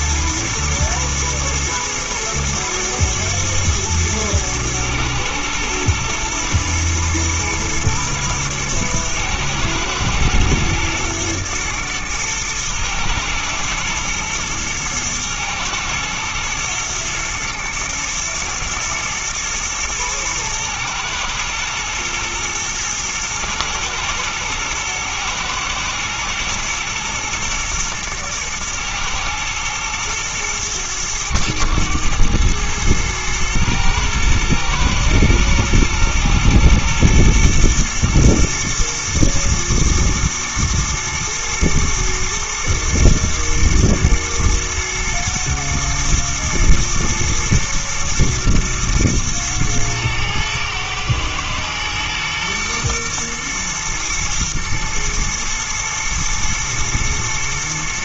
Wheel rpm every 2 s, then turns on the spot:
120, 110, 110, 120, 110, 120, 110, 110, 120, 120, 110, 110, 110, 110, 110, 110, 110, 120, 120, 110, 110, 120, 120, 110, 120, 110, 120, 110, 120.
none